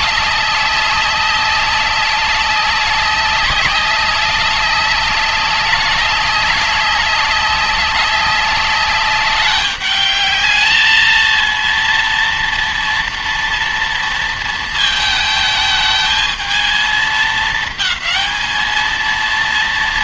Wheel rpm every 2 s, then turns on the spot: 200, 200, 200, 200, 200, 210, 230, 220, 220, 220.
none